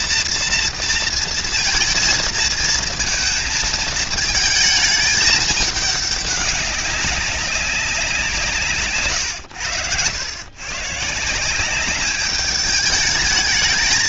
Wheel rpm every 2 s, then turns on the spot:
230, 230, 220, 200, 160, 120, 210.
none